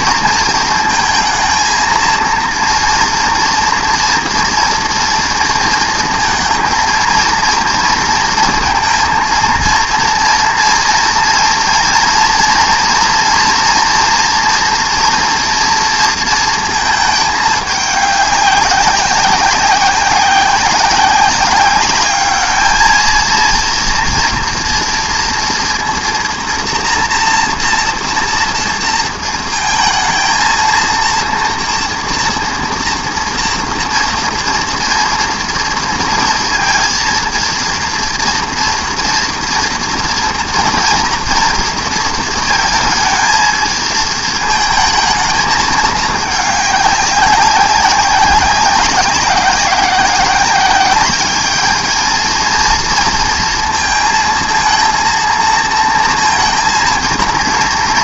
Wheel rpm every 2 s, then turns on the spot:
230, 230, 240, 230, 230, 230, 230, 230, 220, 190, 190, 220, 230, 230, 230, 230, 230, 230, 230, 230, 230, 220, 220, 200, 190, 190, 230, 230, 230.
none